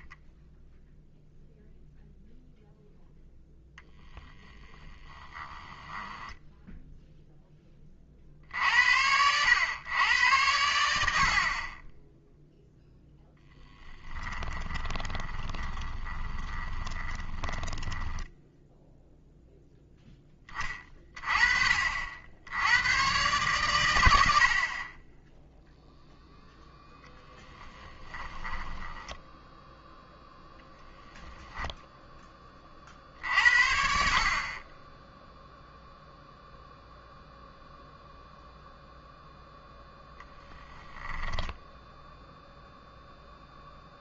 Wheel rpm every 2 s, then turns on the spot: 0, 0, 20, 0, 70, 90, 0, 20, 20, 0, 20, 100, 40, 0, 10, 10, 40, 20, 0, 0, 10, 0.
4-6 14-18 28-30